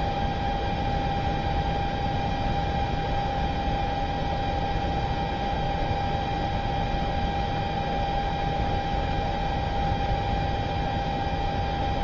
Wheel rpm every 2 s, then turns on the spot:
0, 0, 0, 0, 0, 0.
none